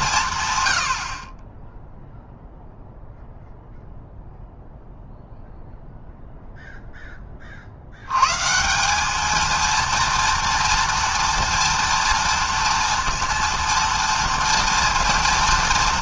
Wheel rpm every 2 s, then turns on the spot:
120, 0, 0, 0, 150, 230, 230, 230.
none